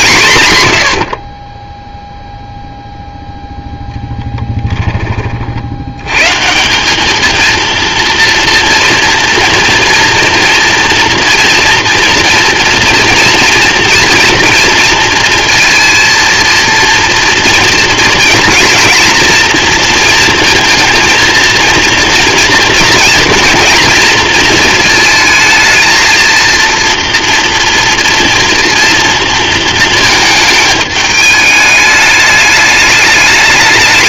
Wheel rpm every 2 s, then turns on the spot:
120, 0, 10, 170, 230, 230, 230, 230, 230, 240, 230, 230, 220, 230, 230, 220, 210.
4-6